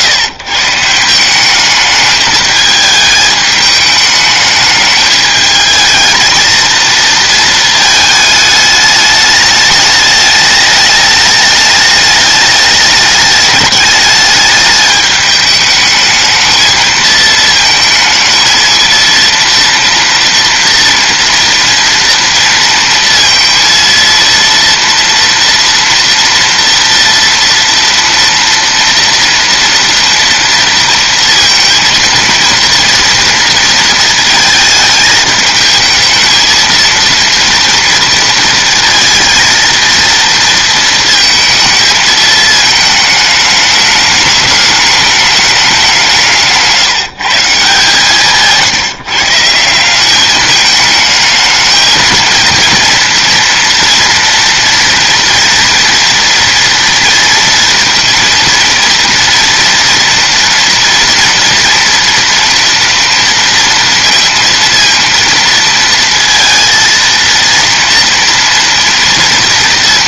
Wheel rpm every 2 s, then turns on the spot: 150, 220, 210, 220, 210, 210, 210, 210, 220, 230, 230, 230, 230, 230, 230, 230, 230, 220, 230, 230, 230, 220, 210, 150, 170, 210, 230, 240, 230, 230, 230, 240, 230, 230, 230.
none